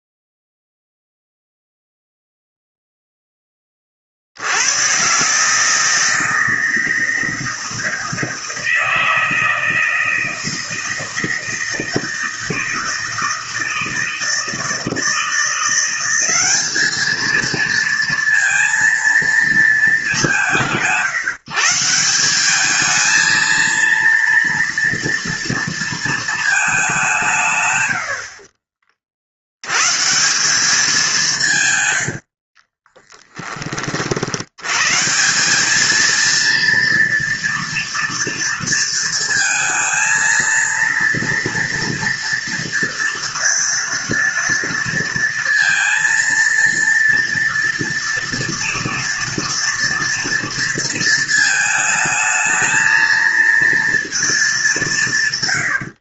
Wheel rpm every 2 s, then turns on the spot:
0, 0, 130, 160, 160, 160, 160, 160, 220, 230, 160, 220, 230, 170, 60, 180, 20, 160, 230, 230, 230, 230, 230, 230, 230, 220, 220, 150.
32-34